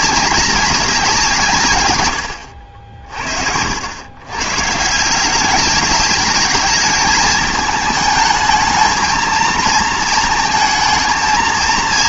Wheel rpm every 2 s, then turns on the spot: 200, 70, 140, 210, 220, 220.
none